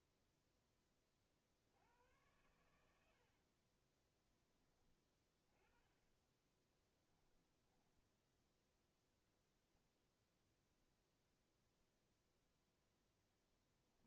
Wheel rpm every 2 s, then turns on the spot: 10, 100, 20, 10, 0, 0, 0.
6-8